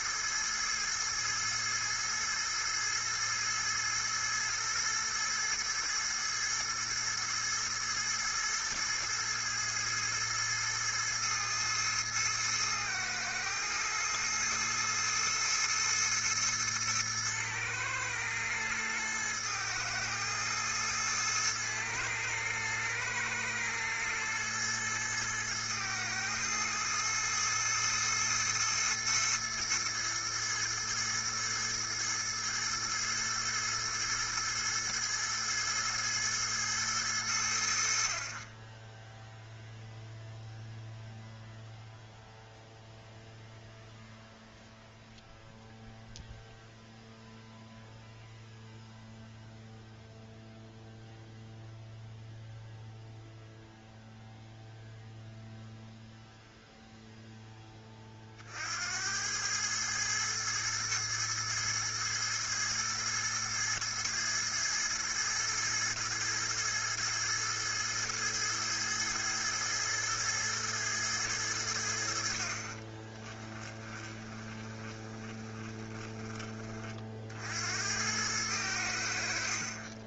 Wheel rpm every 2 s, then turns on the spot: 110, 110, 110, 110, 110, 110, 110, 110, 110, 110, 110, 110, 110, 110, 110, 110, 110, 110, 100, 10, 0, 0, 0, 0, 0, 0, 0, 0, 0, 80, 110, 110, 110, 110, 110, 110, 30, 20, 50, 80.
72-76